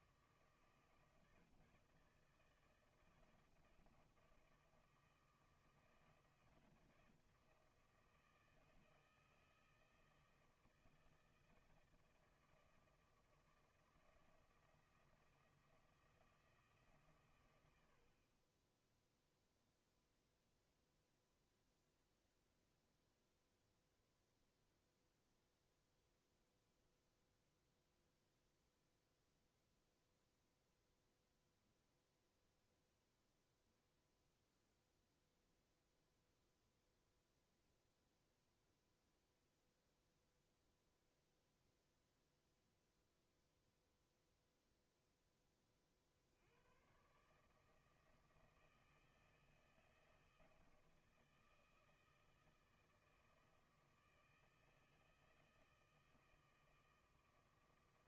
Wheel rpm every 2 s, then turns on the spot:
160, 160, 160, 170, 160, 160, 160, 170, 150, 10, 0, 0, 0, 0, 0, 0, 0, 0, 0, 0, 0, 0, 0, 110, 160, 160, 160, 160, 160.
none